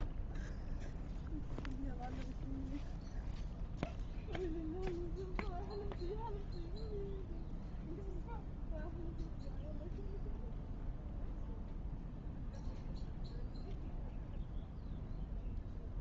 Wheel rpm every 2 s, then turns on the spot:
0, 0, 0, 0, 0, 0, 0, 0.
none